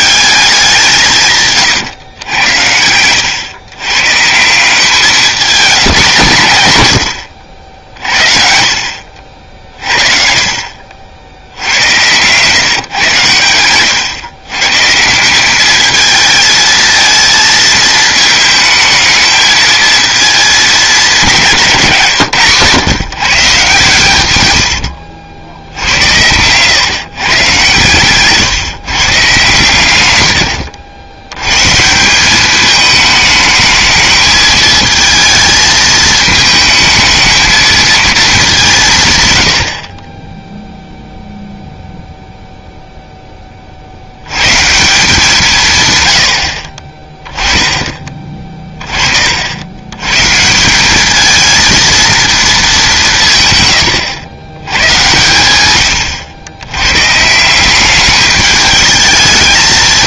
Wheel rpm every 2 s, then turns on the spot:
190, 90, 170, 110, 60, 50, 120, 140, 220, 220, 220, 140, 100, 110, 150, 90, 210, 220, 220, 190, 0, 0, 160, 50, 30, 190, 200, 120, 120, 210.
none